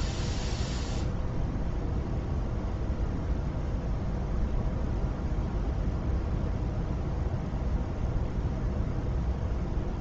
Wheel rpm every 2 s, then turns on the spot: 0, 0, 0, 0, 0.
none